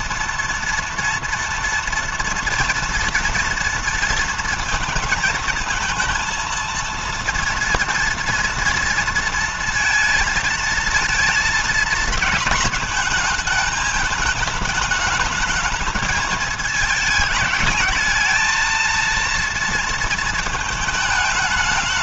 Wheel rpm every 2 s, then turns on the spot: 230, 230, 220, 230, 230, 220, 220, 210, 220, 220, 220.
none